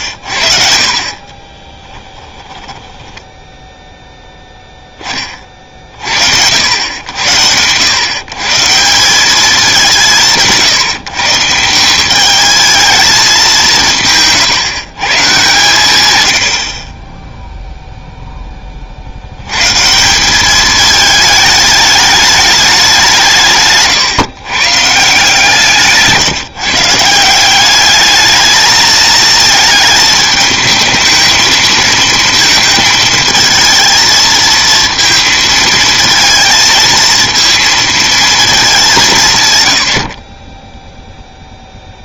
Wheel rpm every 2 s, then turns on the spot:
50, 10, 10, 80, 160, 160, 220, 150, 40, 30, 210, 200, 140, 150, 220, 220, 230, 230, 230, 210, 20.
0-4